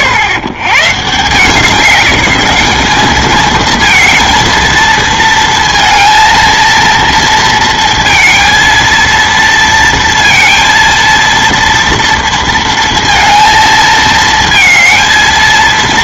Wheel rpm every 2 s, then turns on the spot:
100, 200, 230, 230, 230, 230, 230, 230.
none